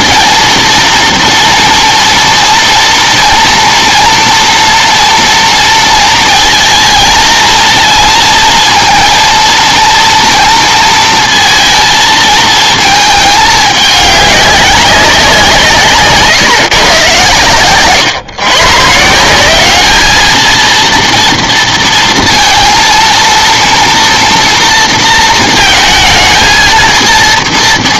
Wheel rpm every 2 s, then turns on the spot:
230, 230, 230, 220, 230, 230, 220, 200, 130, 140, 230, 230, 230, 230.
none